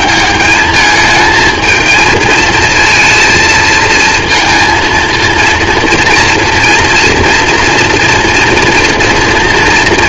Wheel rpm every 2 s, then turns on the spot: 130, 220, 230, 230, 240.
none